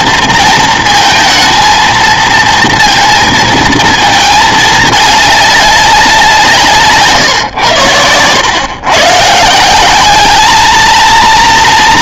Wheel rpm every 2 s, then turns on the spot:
230, 230, 210, 150, 120, 220.
6-8